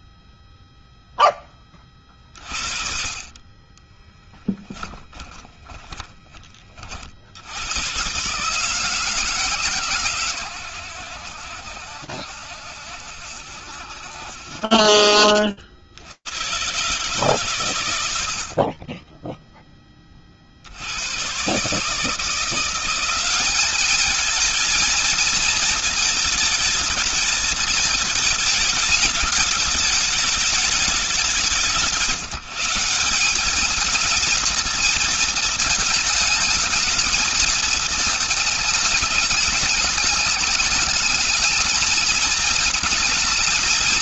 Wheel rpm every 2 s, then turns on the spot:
0, 50, 10, 40, 160, 100, 70, 60, 140, 10, 120, 200, 230, 220, 210, 190, 200, 220, 220, 210, 220, 220.
4-6